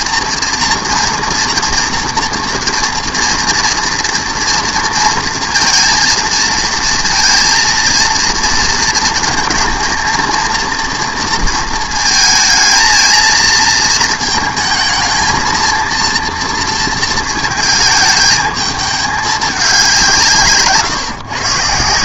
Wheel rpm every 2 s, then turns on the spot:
230, 230, 230, 230, 230, 230, 220, 220, 230, 210, 150.
none